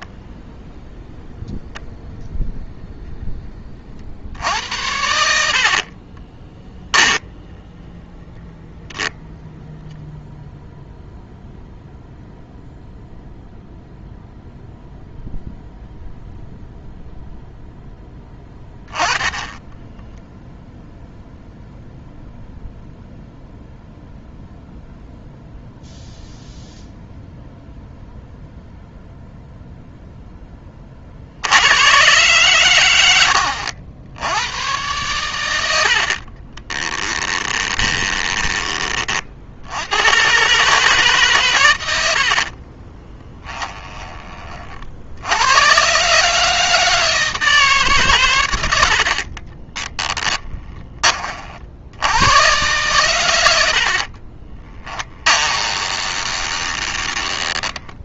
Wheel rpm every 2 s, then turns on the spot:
10, 10, 70, 10, 10, 0, 0, 0, 0, 20, 0, 0, 0, 0, 0, 40, 90, 110, 20, 30, 140, 30, 50, 160, 60, 20, 120, 20, 20.
6-8 36-38 42-44 54-58